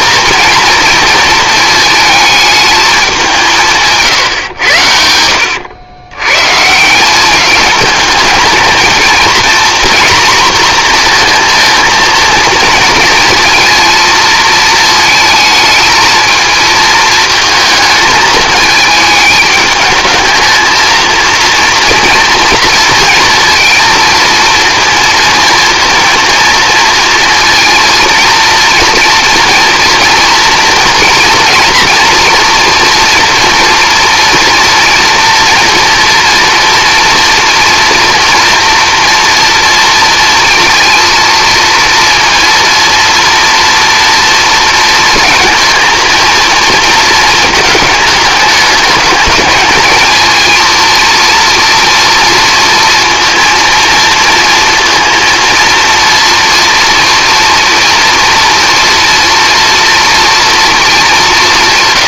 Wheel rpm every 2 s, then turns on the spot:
230, 210, 90, 160, 230, 240, 230, 220, 230, 210, 230, 230, 230, 230, 230, 230, 240, 240, 230, 230, 230, 230, 230, 230, 210, 230, 230, 230, 230, 230, 220.
none